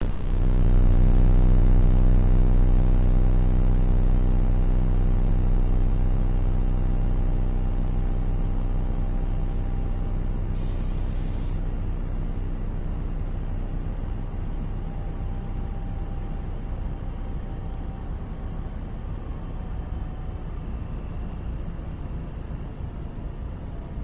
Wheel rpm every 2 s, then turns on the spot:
0, 0, 0, 0, 0, 0, 0, 0, 0, 0, 0, 0.
none